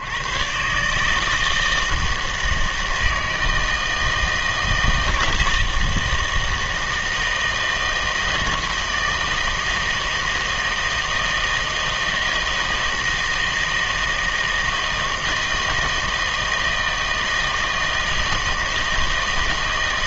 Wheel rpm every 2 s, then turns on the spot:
130, 160, 160, 160, 160, 160, 160, 160, 160, 160.
none